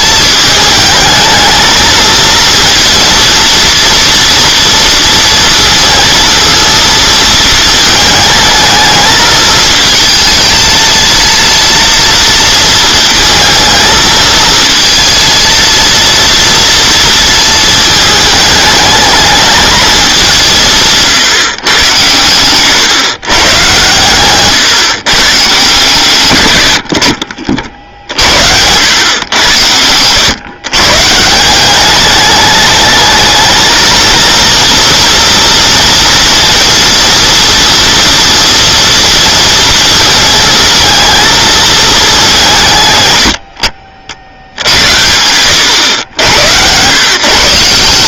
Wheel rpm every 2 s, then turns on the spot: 220, 230, 230, 230, 220, 220, 230, 230, 230, 210, 170, 120, 130, 100, 80, 120, 210, 230, 230, 230, 220, 160, 80, 110.
26-28